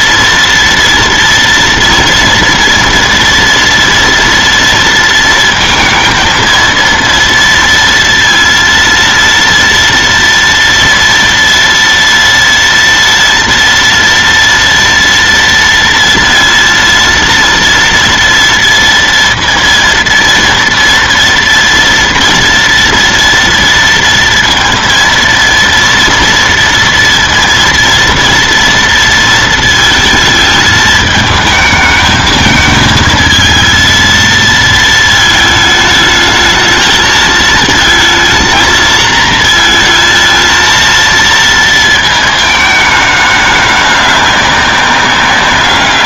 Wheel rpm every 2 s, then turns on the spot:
240, 240, 230, 230, 230, 230, 230, 230, 230, 230, 230, 230, 230, 230, 230, 220, 220, 220, 220, 230, 230, 220, 200.
none